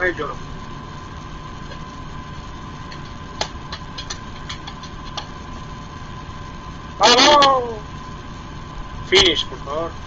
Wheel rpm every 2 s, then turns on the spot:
0, 0, 0, 0, 0.
none